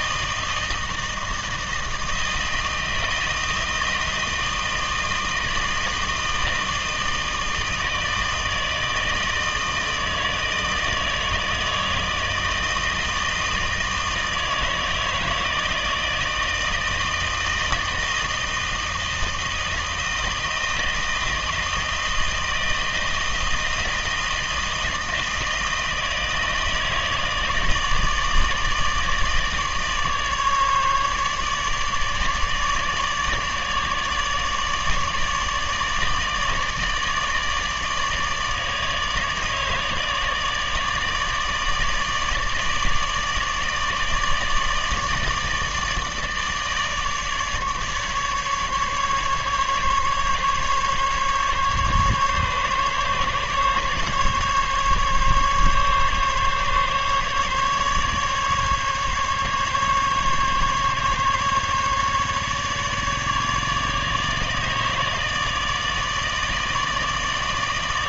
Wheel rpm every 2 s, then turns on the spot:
160, 160, 160, 160, 160, 160, 160, 160, 160, 160, 160, 160, 160, 160, 160, 150, 150, 150, 160, 160, 160, 150, 150, 150, 150, 140, 140, 140, 140, 140, 140, 150, 150, 160.
none